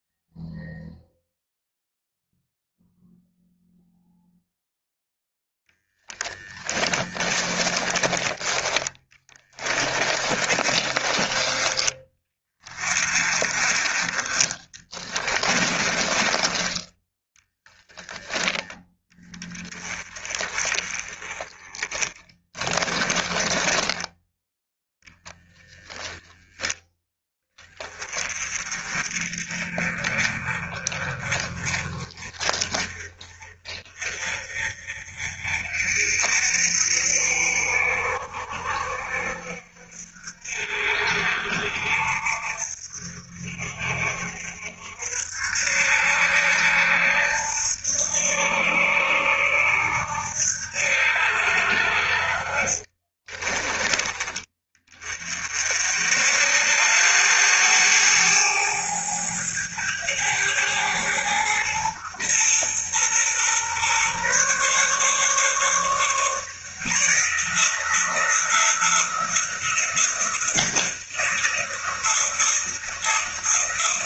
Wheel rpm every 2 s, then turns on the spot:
0, 0, 10, 20, 10, 30, 30, 20, 10, 10, 20, 20, 0, 20, 30, 30, 30, 40, 60, 60, 60, 50, 60, 70, 80, 70, 30, 30, 90, 110, 110, 120, 140, 160, 170, 170, 170.
6-12 14-16 52-54